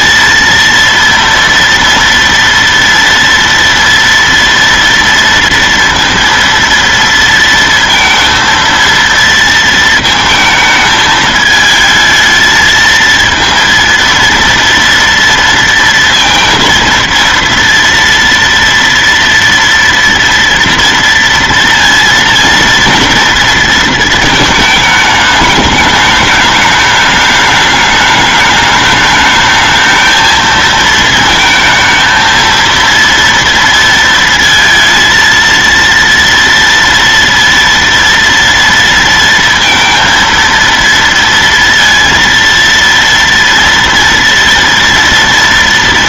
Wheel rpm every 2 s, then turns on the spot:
230, 230, 230, 230, 230, 220, 230, 230, 230, 230, 230, 230, 220, 210, 210, 220, 230, 230, 230, 230, 230, 230, 230.
none